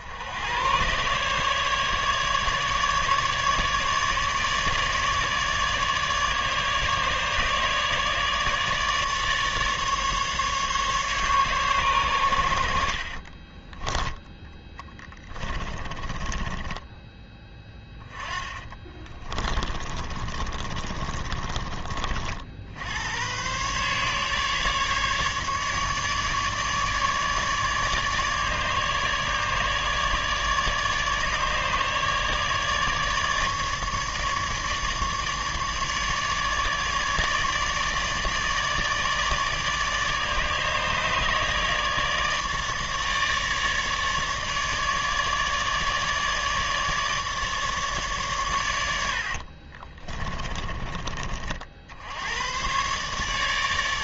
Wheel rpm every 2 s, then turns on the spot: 110, 150, 150, 150, 150, 150, 80, 10, 20, 20, 30, 70, 150, 150, 150, 150, 150, 150, 150, 150, 150, 150, 150, 150, 100, 20, 110.
14-22 50-52